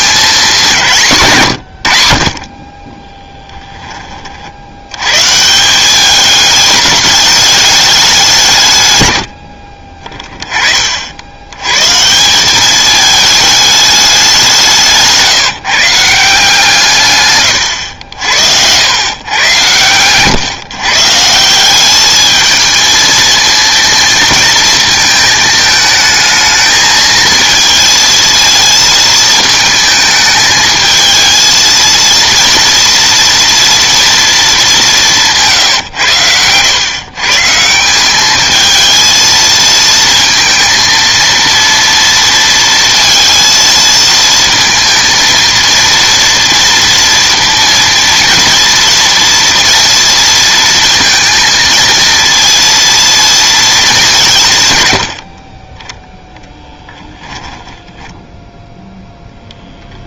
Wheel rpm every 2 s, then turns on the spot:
170, 10, 100, 210, 120, 50, 210, 170, 150, 100, 140, 220, 220, 220, 230, 220, 230, 190, 120, 220, 230, 230, 230, 230, 230, 230, 230, 120, 0, 0.
2-4 14-16